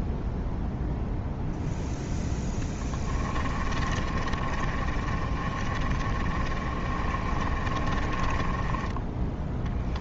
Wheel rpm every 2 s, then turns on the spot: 0, 20, 30, 30, 10.
2-8